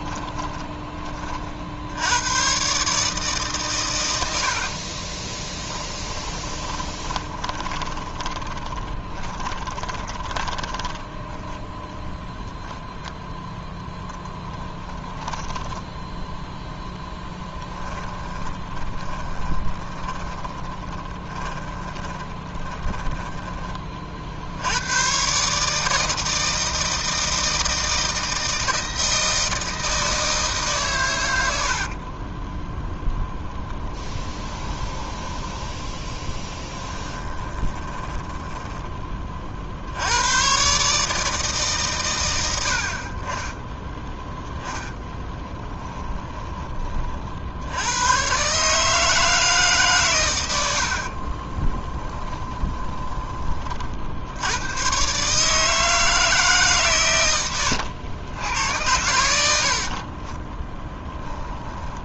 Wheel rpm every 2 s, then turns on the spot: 20, 140, 30, 20, 20, 10, 0, 10, 0, 10, 20, 10, 100, 160, 160, 140, 0, 20, 10, 10, 140, 70, 10, 30, 150, 70, 20, 120, 130, 90, 10.
0-2 4-12 14-16 18-24 34-38 44-46 52-54